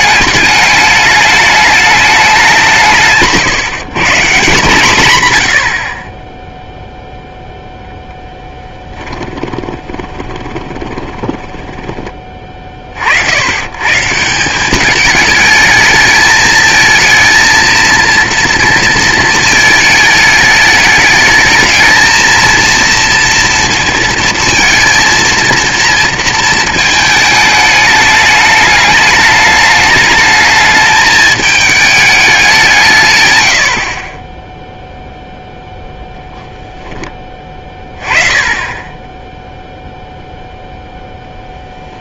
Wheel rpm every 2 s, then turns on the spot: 210, 170, 150, 0, 10, 20, 40, 190, 220, 230, 210, 230, 230, 220, 210, 220, 170, 0, 0, 20, 0.
8-12